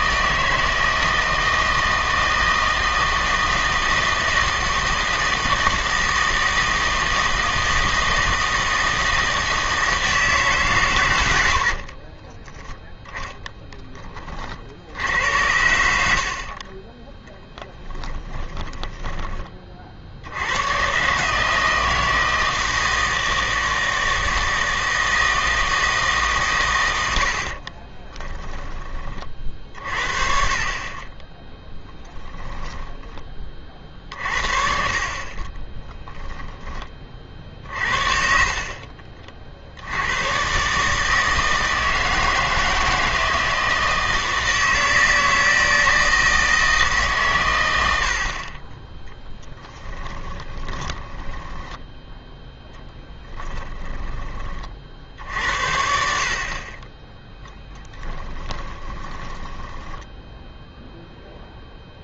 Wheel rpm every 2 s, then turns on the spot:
160, 160, 160, 160, 160, 130, 10, 60, 40, 20, 100, 160, 160, 120, 20, 40, 20, 50, 20, 50, 130, 160, 160, 160, 30, 20, 10, 40, 30, 20, 0.
16-20 32-36 50-52 58-60